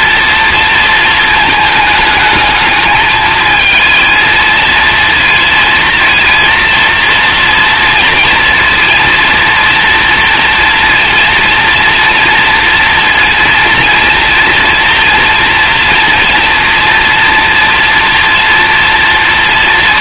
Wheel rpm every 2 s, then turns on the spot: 230, 220, 220, 230, 230, 230, 230, 230, 230, 230.
none